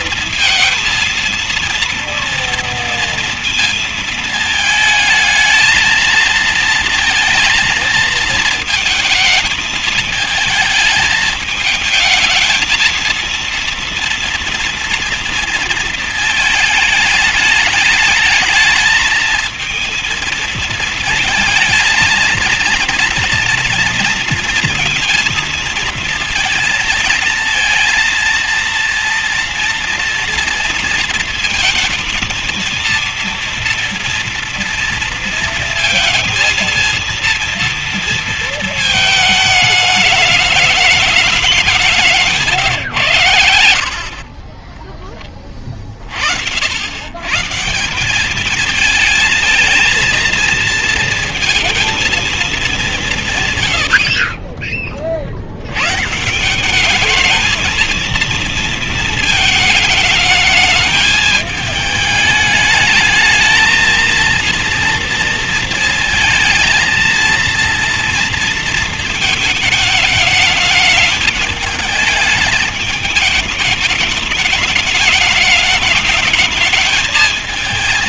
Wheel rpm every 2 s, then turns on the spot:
230, 230, 220, 230, 220, 220, 220, 230, 210, 220, 230, 230, 230, 230, 230, 230, 230, 240, 230, 220, 210, 120, 20, 80, 220, 230, 200, 30, 200, 230, 220, 210, 230, 230, 220, 210, 210, 210, 220.
none